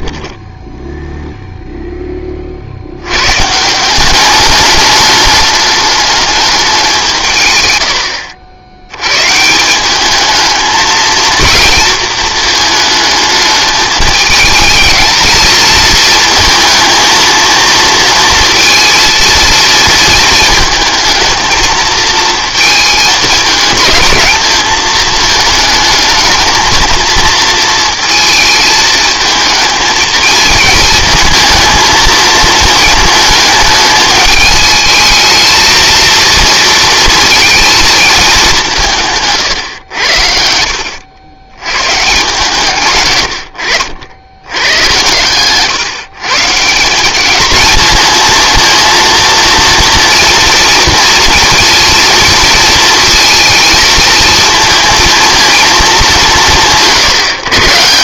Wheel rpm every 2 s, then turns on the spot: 0, 50, 200, 190, 80, 220, 220, 210, 220, 230, 220, 220, 220, 220, 220, 220, 220, 210, 230, 170, 70, 120, 110, 170, 230, 230, 230, 230, 170.
none